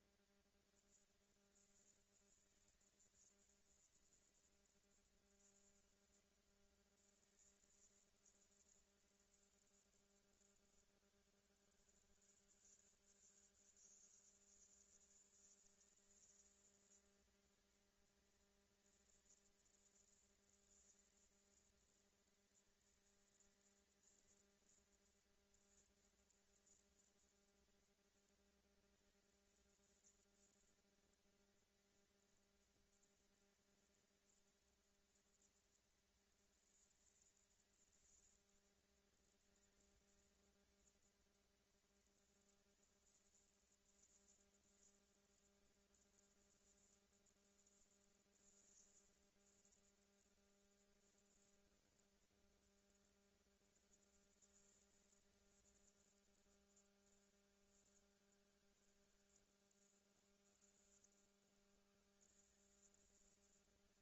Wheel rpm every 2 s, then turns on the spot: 230, 230, 230, 230, 220, 170, 160, 180, 220, 230, 230, 220, 230, 230, 230, 230, 230, 230, 230, 230, 230, 230, 230, 230, 230, 230, 220, 230, 190, 150, 80, 170.
none